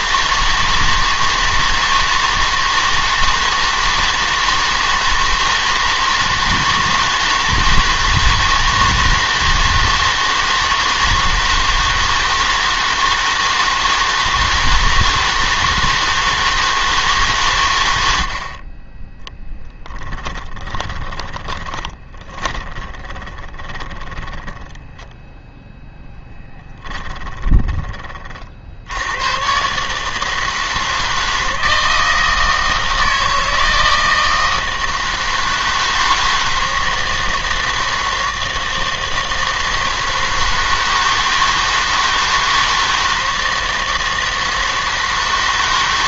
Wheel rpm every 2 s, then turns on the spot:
160, 160, 160, 160, 170, 160, 160, 160, 160, 30, 20, 20, 10, 10, 60, 160, 160, 160, 160, 160, 160, 160, 160.
20-24 26-28